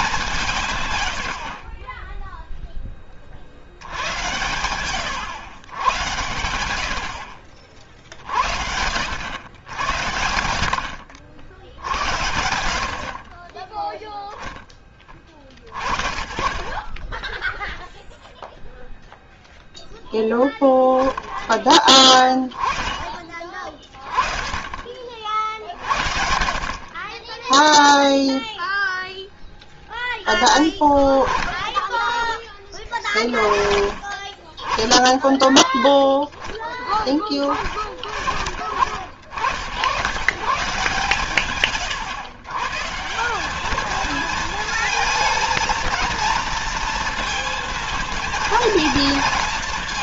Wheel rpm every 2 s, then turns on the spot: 150, 10, 110, 70, 80, 70, 60, 20, 30, 0, 0, 30, 30, 20, 0, 10, 20, 20, 10, 40, 150, 150, 230, 230, 230.
0-2 26-28